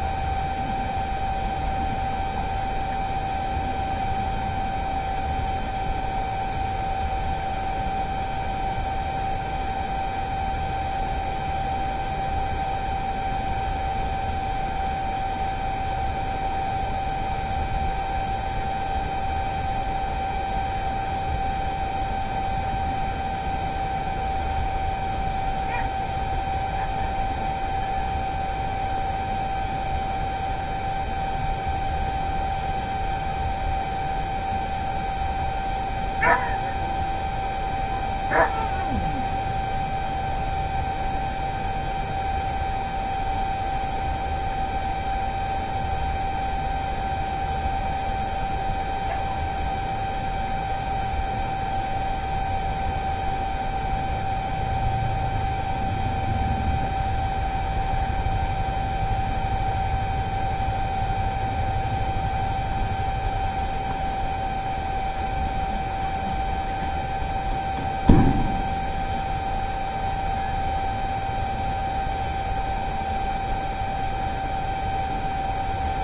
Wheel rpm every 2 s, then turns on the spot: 0, 0, 0, 0, 0, 0, 0, 0, 0, 0, 0, 0, 0, 0, 0, 0, 0, 0, 0, 0, 0, 0, 0, 0, 0, 0, 0, 0, 0, 0, 0, 0, 0, 0, 0, 0, 0, 0.
none